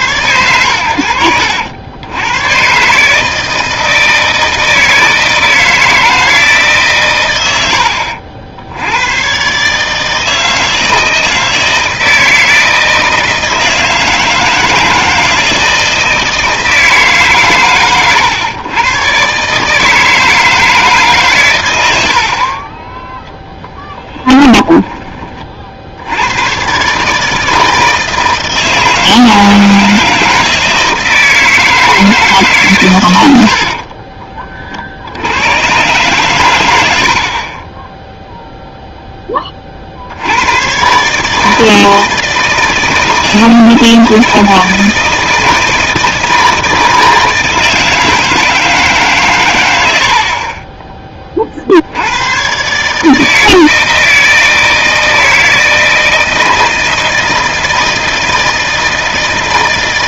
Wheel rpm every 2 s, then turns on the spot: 100, 120, 160, 150, 80, 160, 160, 160, 160, 110, 160, 30, 20, 120, 160, 160, 140, 50, 90, 0, 120, 160, 160, 160, 160, 30, 130, 160, 160, 160.
22-26